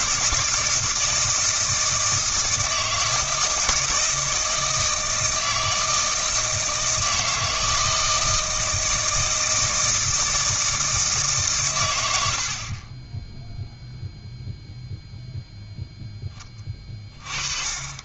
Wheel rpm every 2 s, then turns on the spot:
160, 160, 160, 160, 160, 160, 40, 0, 30.
none